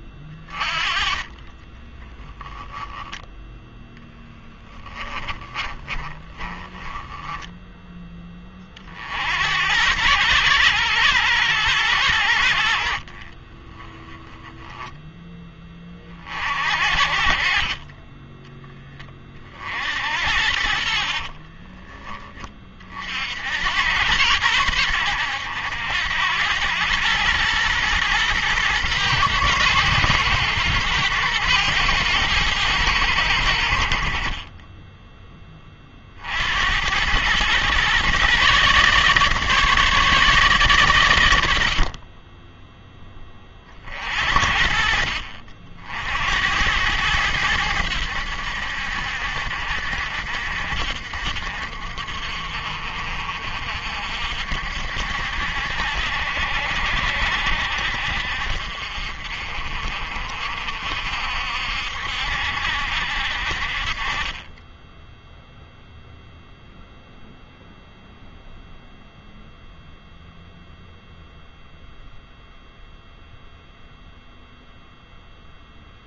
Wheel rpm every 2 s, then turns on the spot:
30, 0, 10, 10, 40, 110, 60, 10, 70, 10, 50, 30, 100, 100, 120, 110, 100, 20, 80, 140, 130, 10, 50, 90, 70, 60, 50, 60, 70, 60, 50, 70, 10, 0, 0, 0, 0, 0.
4-8